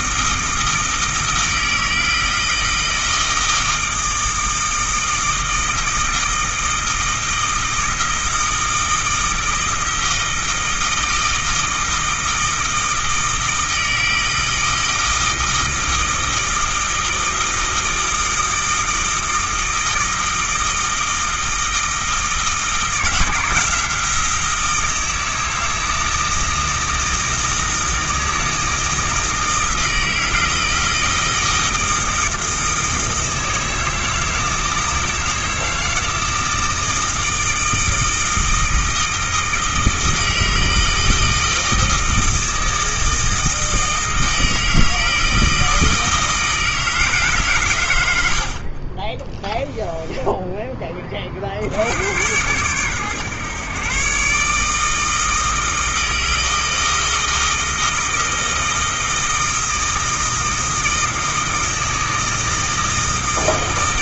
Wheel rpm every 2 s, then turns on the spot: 160, 160, 160, 160, 160, 160, 160, 160, 160, 160, 160, 160, 160, 160, 160, 160, 160, 160, 160, 160, 160, 160, 160, 160, 40, 20, 120, 150, 160, 160, 160, 160.
none